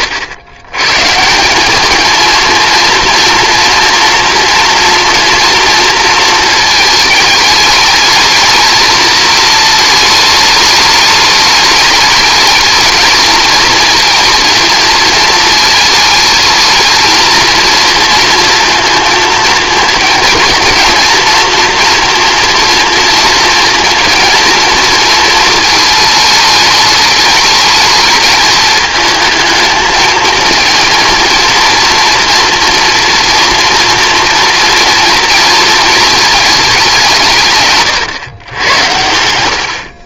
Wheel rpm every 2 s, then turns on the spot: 120, 230, 230, 220, 220, 210, 220, 220, 220, 230, 230, 230, 220, 210, 220, 230, 230, 240, 190, 90.
none